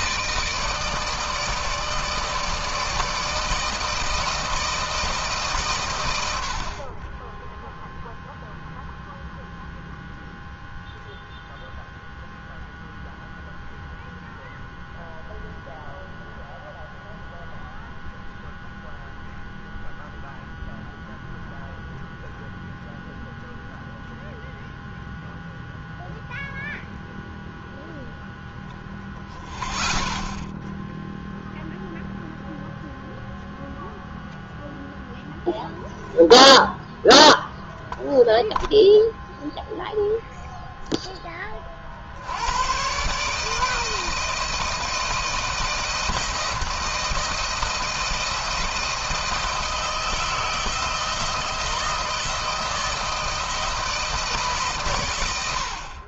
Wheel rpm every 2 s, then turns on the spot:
160, 160, 160, 90, 0, 0, 0, 0, 0, 0, 0, 0, 0, 0, 0, 0, 0, 0, 0, 0, 0, 80, 160, 170, 170, 170, 170, 150.
none